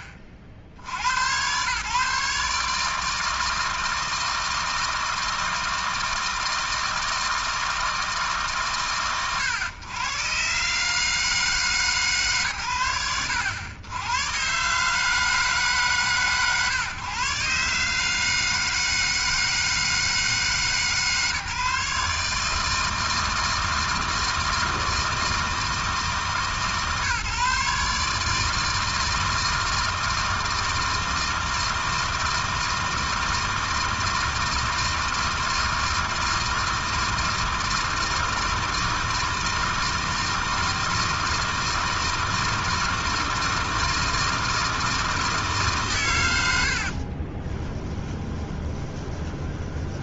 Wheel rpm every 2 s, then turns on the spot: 90, 150, 160, 160, 110, 150, 80, 150, 130, 160, 150, 160, 160, 150, 160, 160, 160, 160, 160, 160, 160, 160, 160, 40, 20.
46-50